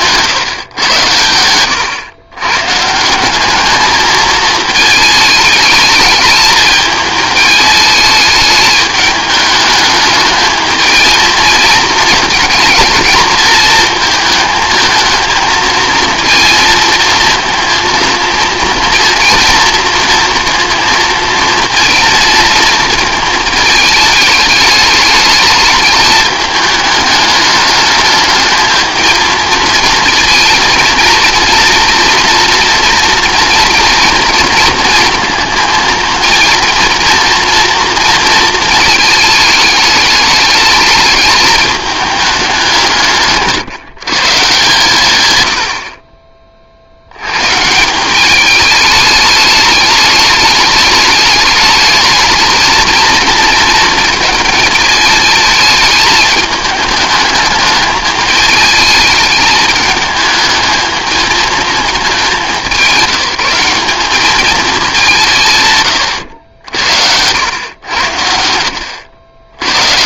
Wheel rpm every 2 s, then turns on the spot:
110, 150, 220, 220, 210, 220, 220, 220, 230, 230, 230, 230, 210, 210, 220, 230, 230, 230, 230, 220, 220, 170, 140, 60, 210, 210, 220, 220, 210, 210, 220, 190, 210, 70, 80.
none